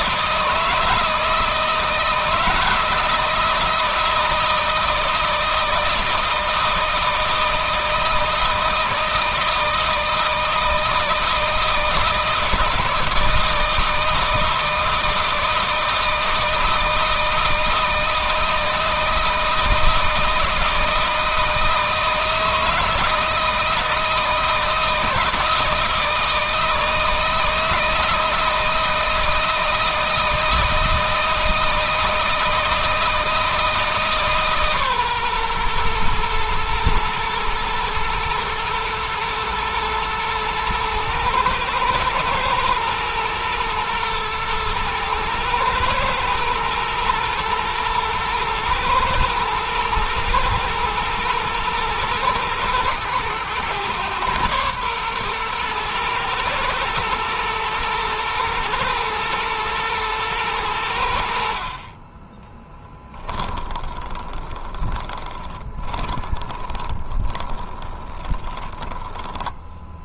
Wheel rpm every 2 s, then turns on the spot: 160, 160, 160, 160, 160, 160, 160, 160, 160, 160, 160, 160, 160, 160, 160, 160, 160, 140, 110, 110, 110, 110, 110, 110, 110, 110, 110, 120, 120, 110, 90, 10, 20, 20, 10.
62-70